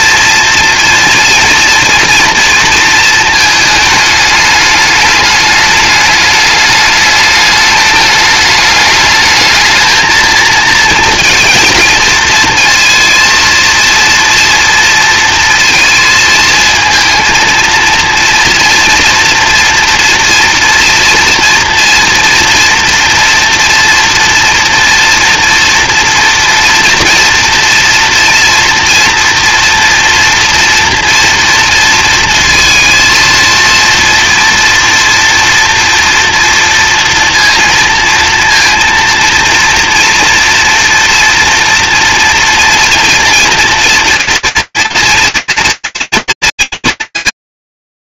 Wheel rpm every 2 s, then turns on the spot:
230, 220, 210, 210, 220, 230, 230, 230, 230, 230, 230, 230, 240, 230, 230, 230, 230, 230, 230, 230, 230, 230, 230, 210.
none